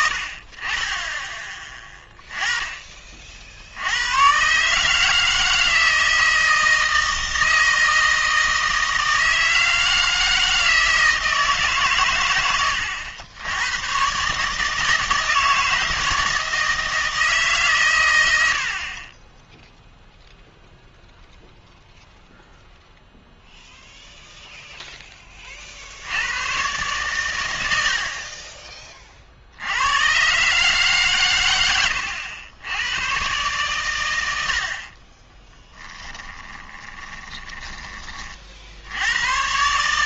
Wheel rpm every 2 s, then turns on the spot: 40, 30, 150, 160, 160, 160, 100, 150, 160, 60, 0, 0, 0, 120, 30, 140, 90, 60, 20, 60.
36-38